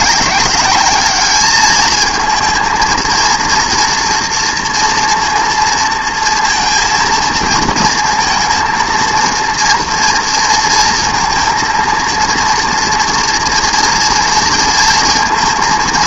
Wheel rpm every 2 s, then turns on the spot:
200, 230, 230, 230, 230, 230, 230, 230.
none